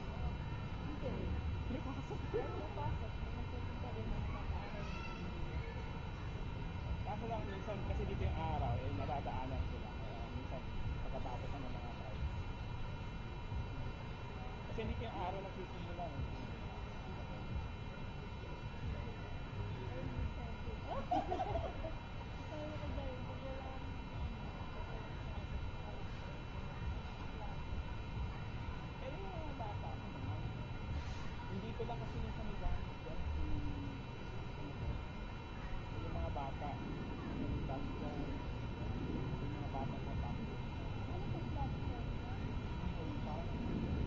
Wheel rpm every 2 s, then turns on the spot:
0, 0, 0, 0, 0, 0, 0, 0, 0, 0, 0, 0, 0, 0, 0, 0, 0, 0, 0, 0, 0, 0.
none